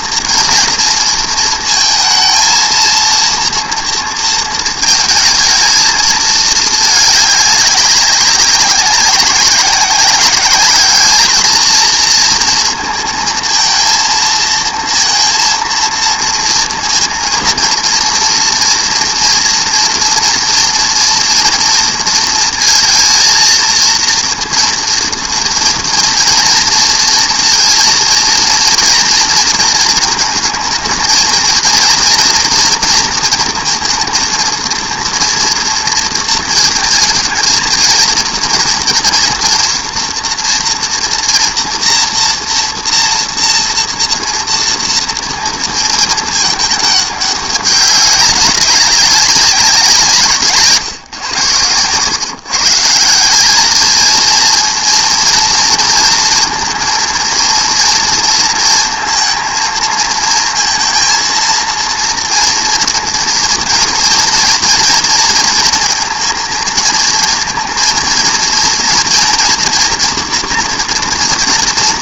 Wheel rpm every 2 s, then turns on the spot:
230, 230, 220, 210, 190, 220, 230, 230, 230, 230, 230, 230, 240, 230, 230, 220, 230, 230, 230, 230, 240, 230, 230, 210, 200, 130, 170, 230, 230, 230, 230, 230, 230, 230, 240, 240.
none